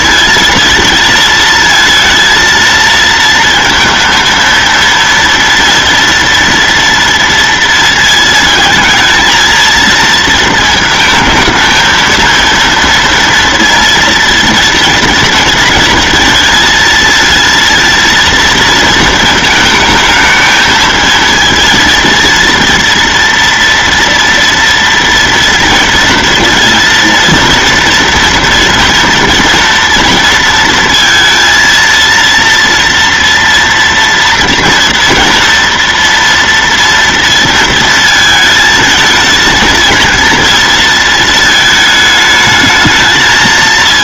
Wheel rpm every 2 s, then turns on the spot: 220, 230, 230, 230, 220, 220, 230, 230, 220, 230, 220, 230, 230, 230, 230, 230, 230, 230, 230, 220, 230, 220.
none